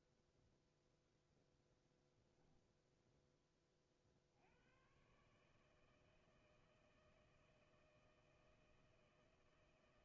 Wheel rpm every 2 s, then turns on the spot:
0, 0, 120, 160, 160.
none